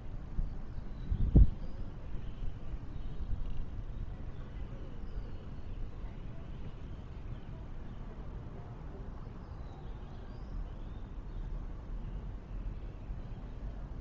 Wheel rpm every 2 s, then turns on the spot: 0, 0, 0, 0, 0, 0, 0.
none